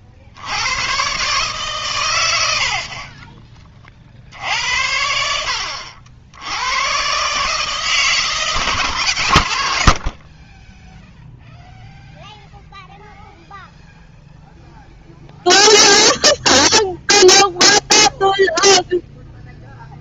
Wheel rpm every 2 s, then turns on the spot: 130, 30, 70, 130, 140, 0, 0, 0, 0, 0.
2-4